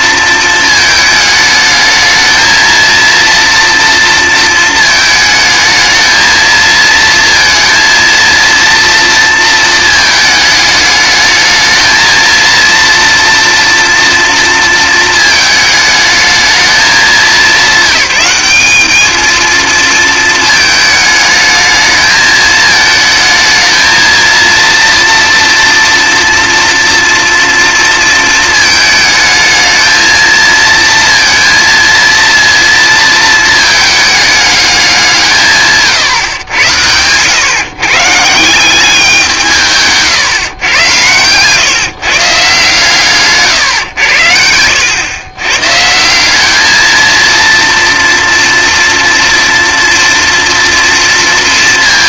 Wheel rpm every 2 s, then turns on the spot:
220, 230, 220, 230, 230, 210, 230, 230, 200, 210, 220, 220, 230, 230, 220, 230, 230, 190, 110, 190, 110, 140, 90, 220, 230, 240.
none